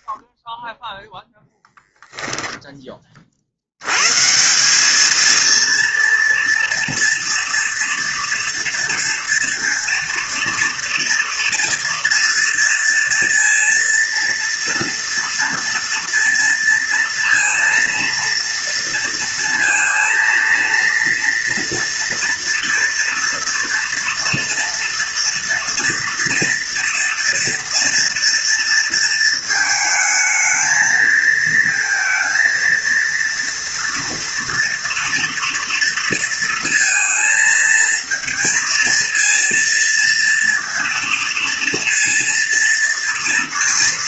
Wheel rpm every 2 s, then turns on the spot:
0, 10, 180, 230, 240, 230, 230, 230, 230, 230, 230, 230, 230, 230, 230, 220, 230, 230, 230, 230, 230, 230.
none